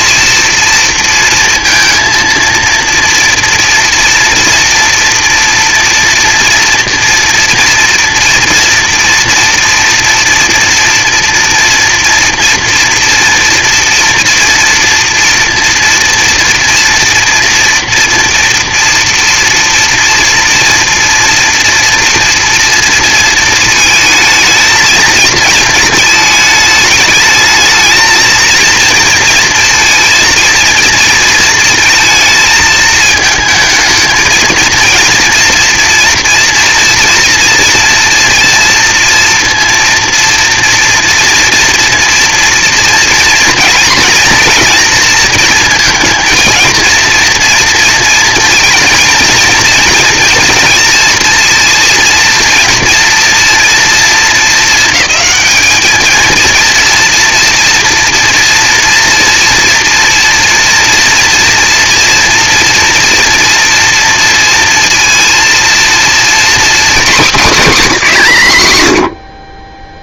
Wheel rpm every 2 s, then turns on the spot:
230, 230, 230, 230, 230, 240, 230, 230, 230, 230, 230, 230, 220, 220, 230, 230, 220, 230, 230, 230, 230, 240, 230, 230, 230, 230, 230, 220, 230, 240, 230, 230, 230, 250, 170.
none